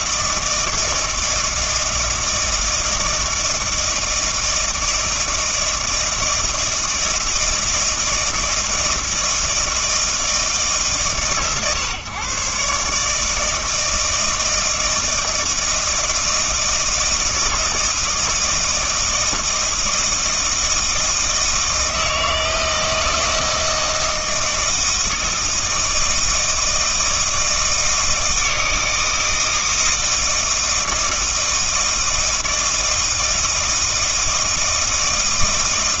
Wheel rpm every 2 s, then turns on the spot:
160, 160, 160, 160, 160, 140, 130, 160, 160, 160, 160, 160, 160, 160, 160, 160, 160, 160.
none